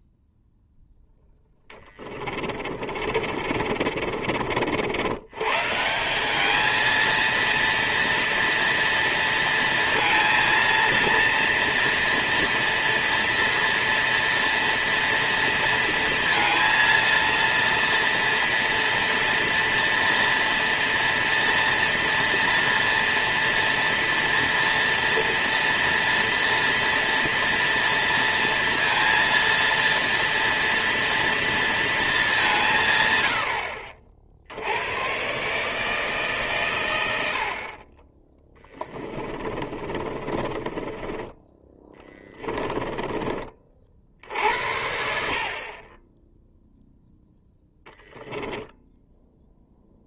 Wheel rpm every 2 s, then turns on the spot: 0, 40, 90, 220, 230, 230, 230, 230, 230, 230, 230, 230, 230, 240, 230, 230, 150, 100, 120, 10, 20, 20, 70, 0, 10.
2-4 38-44